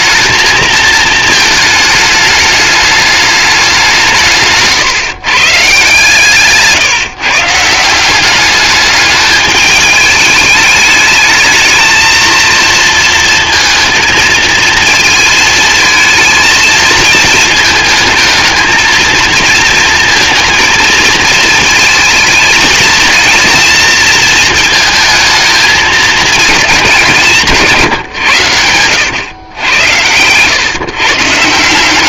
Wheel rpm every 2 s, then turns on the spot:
230, 210, 150, 150, 210, 220, 230, 220, 220, 220, 220, 220, 220, 190, 100, 130.
none